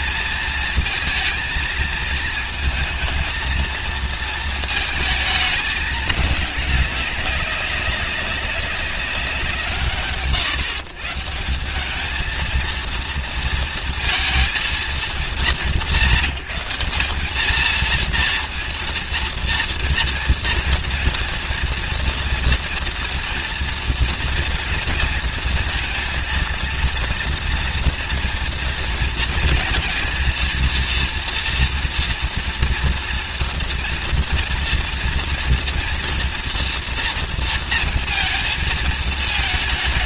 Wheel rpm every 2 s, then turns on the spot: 230, 230, 220, 210, 200, 140, 230, 220, 190, 230, 230, 230, 230, 230, 230, 230, 230, 230, 230, 230.
none